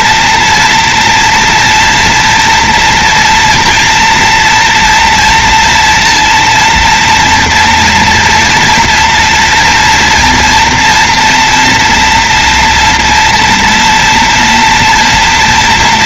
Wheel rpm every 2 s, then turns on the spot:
230, 240, 230, 230, 240, 230, 240, 230.
none